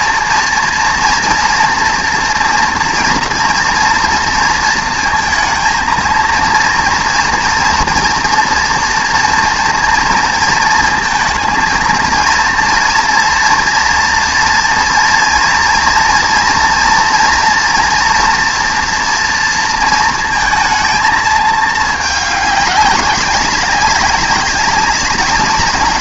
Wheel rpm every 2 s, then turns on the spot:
230, 230, 230, 230, 230, 230, 230, 230, 230, 230, 220, 210, 200.
none